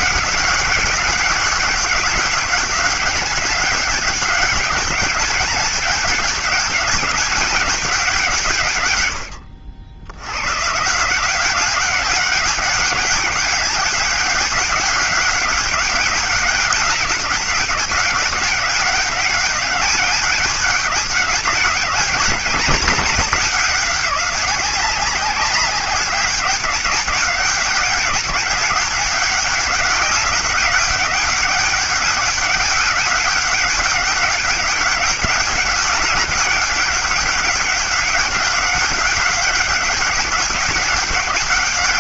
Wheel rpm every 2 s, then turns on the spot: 190, 190, 200, 200, 130, 130, 200, 200, 200, 190, 200, 200, 190, 200, 190, 200, 200, 200, 200, 200, 200.
none